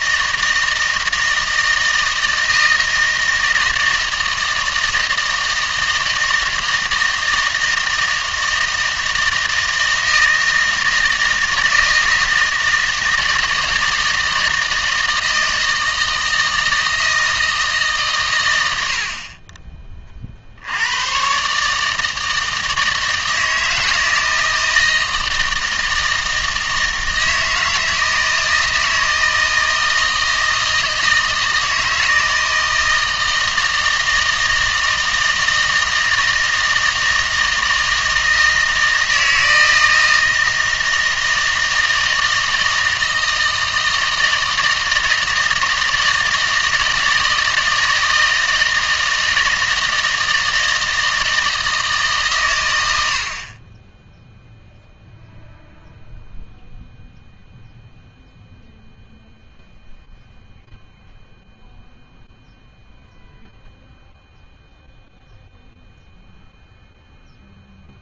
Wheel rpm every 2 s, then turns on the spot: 160, 160, 160, 160, 160, 160, 160, 160, 160, 90, 80, 160, 160, 160, 160, 160, 160, 160, 160, 160, 160, 160, 160, 160, 160, 160, 100, 0, 0, 0, 0, 0, 0, 0.
none